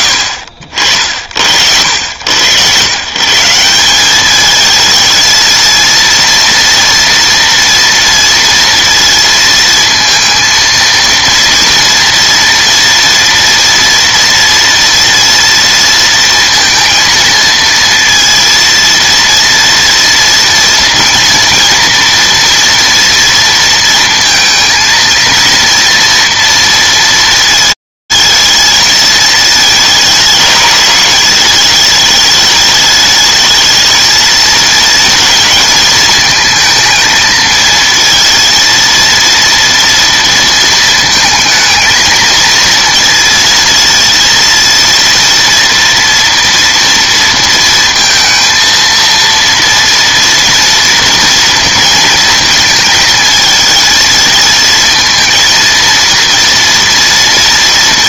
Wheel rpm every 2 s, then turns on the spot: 80, 120, 220, 240, 230, 230, 230, 230, 230, 230, 230, 230, 230, 230, 220, 210, 220, 220, 220, 230, 220, 230, 230, 230, 230, 230, 220, 230, 230.
none